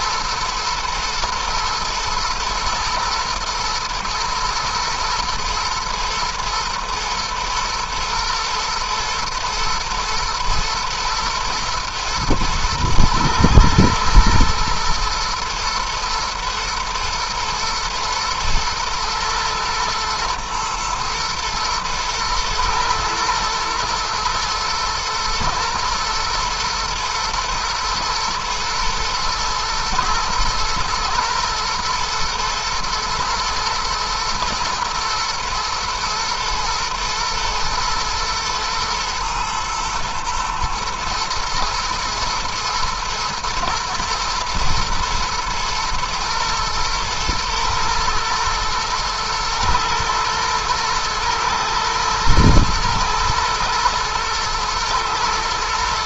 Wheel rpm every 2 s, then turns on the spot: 120, 120, 110, 110, 120, 110, 110, 110, 120, 110, 110, 110, 110, 110, 110, 120, 120, 120, 120, 120, 110, 120, 120, 120, 110, 110, 120, 110.
none